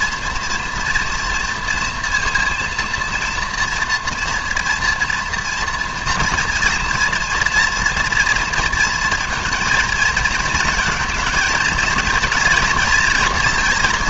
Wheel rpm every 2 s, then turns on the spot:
230, 240, 240, 230, 230, 230, 230.
none